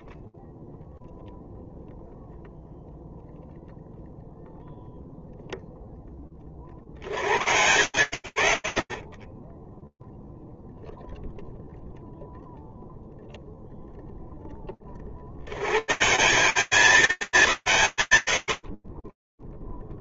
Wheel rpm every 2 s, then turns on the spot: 0, 0, 0, 140, 80, 0, 0, 80, 190, 100.
none